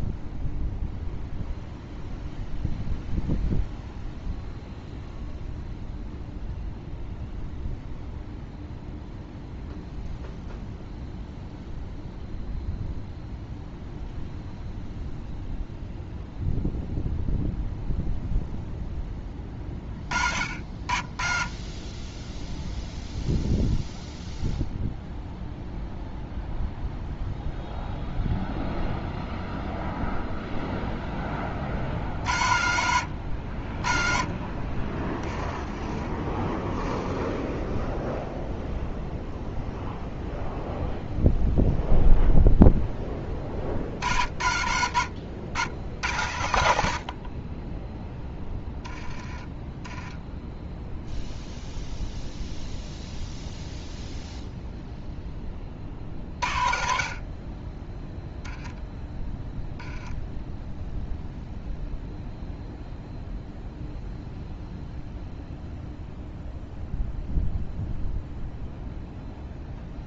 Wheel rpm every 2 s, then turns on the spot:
0, 0, 0, 0, 0, 0, 0, 0, 0, 10, 50, 0, 0, 0, 0, 0, 70, 20, 10, 0, 0, 10, 70, 70, 10, 0, 0, 0, 40, 0, 0, 0, 0, 0, 0.
none